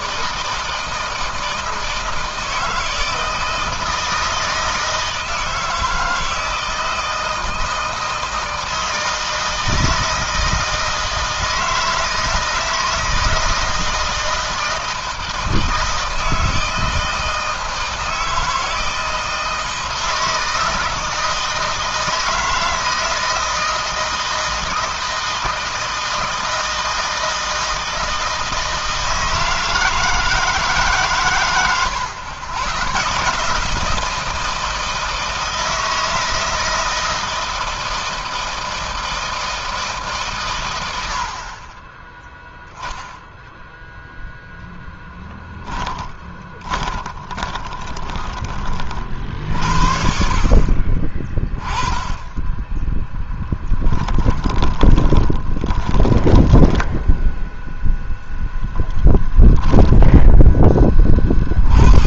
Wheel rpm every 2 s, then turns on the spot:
160, 160, 160, 160, 160, 160, 160, 160, 160, 160, 160, 160, 160, 160, 160, 130, 120, 160, 160, 160, 100, 0, 0, 20, 40, 30, 10, 20, 0, 10, 10.
46-48 52-56